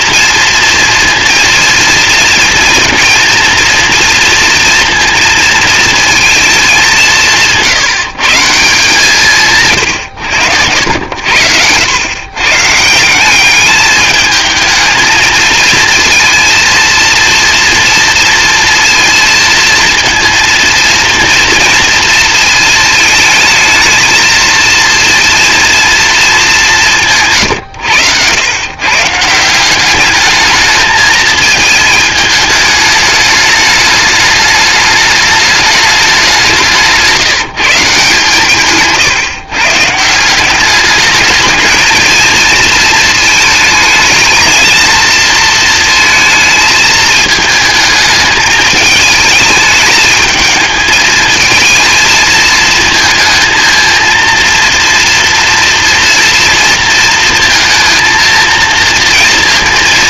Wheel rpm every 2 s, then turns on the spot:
230, 230, 230, 200, 150, 90, 150, 220, 230, 230, 230, 220, 230, 180, 120, 210, 210, 210, 180, 140, 200, 230, 220, 220, 220, 220, 220, 230, 230, 230.
none